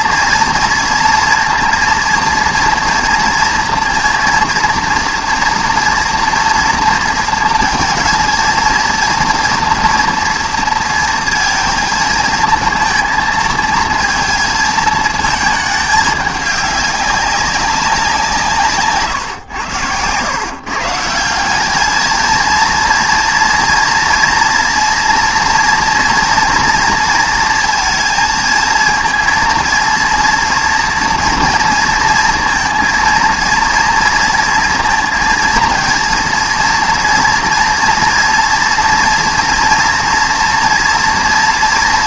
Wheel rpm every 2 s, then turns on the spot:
230, 230, 230, 230, 230, 230, 230, 220, 200, 140, 150, 230, 230, 240, 230, 230, 230, 230, 230, 230, 230.
none